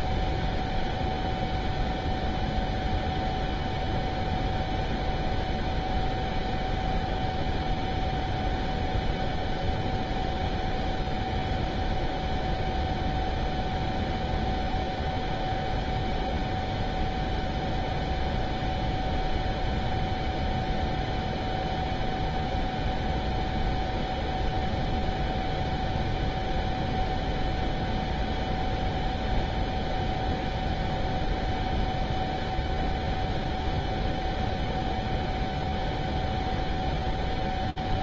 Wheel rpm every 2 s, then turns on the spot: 0, 0, 0, 0, 0, 0, 0, 0, 0, 0, 0, 0, 0, 0, 0, 0, 0, 0, 0.
none